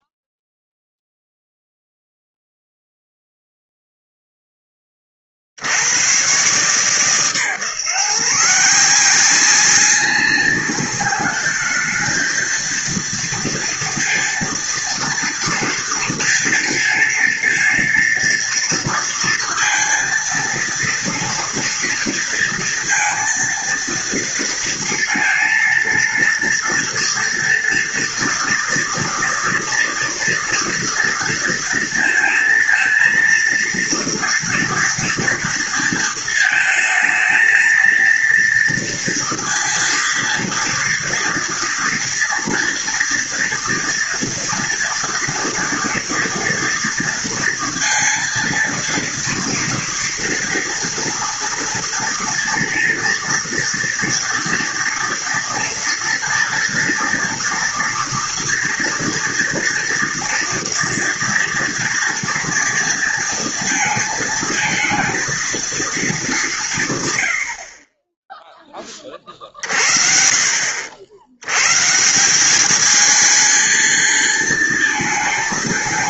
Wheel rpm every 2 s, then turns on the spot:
0, 0, 20, 130, 160, 200, 220, 230, 230, 230, 230, 230, 230, 230, 230, 230, 230, 230, 220, 230, 230, 230, 230, 230, 230, 230, 230, 230, 240, 230, 230, 230, 220, 160, 10, 70, 210, 220.
none